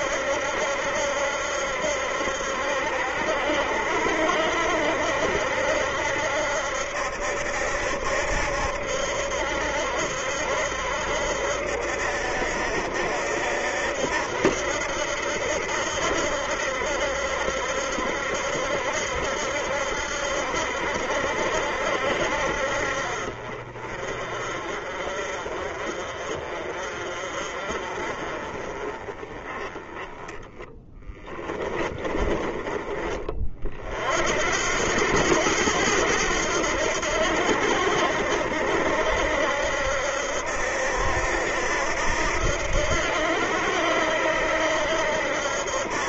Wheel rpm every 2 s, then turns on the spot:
70, 70, 70, 70, 70, 70, 70, 80, 70, 70, 70, 50, 40, 40, 20, 10, 20, 90, 80, 70, 80, 80, 80.
30-32